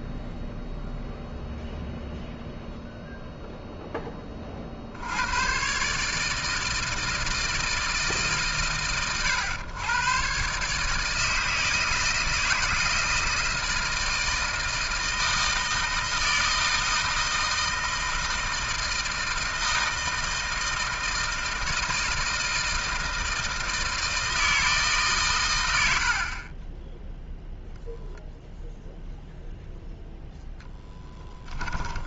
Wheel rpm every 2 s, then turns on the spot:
0, 0, 120, 160, 120, 160, 160, 160, 160, 160, 160, 160, 130, 0, 0, 10.
30-32